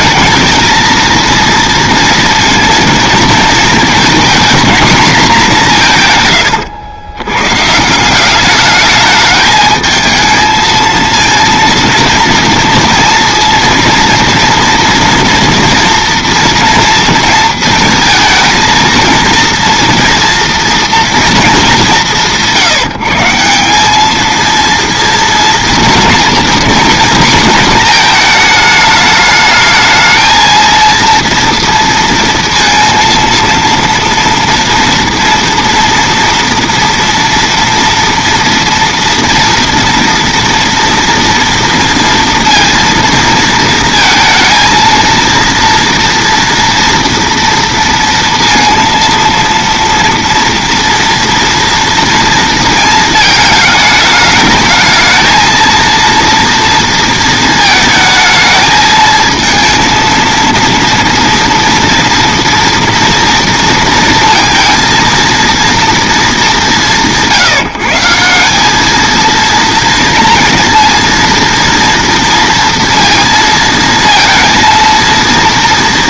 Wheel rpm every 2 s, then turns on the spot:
220, 230, 230, 100, 210, 220, 230, 230, 230, 220, 230, 170, 230, 240, 220, 230, 230, 230, 230, 230, 230, 230, 230, 230, 230, 240, 230, 220, 230, 220, 230, 230, 230, 190, 210, 230, 230, 230.
none